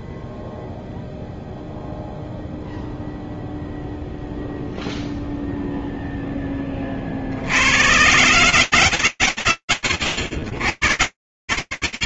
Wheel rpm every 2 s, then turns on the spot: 0, 0, 0, 40, 100, 130.
none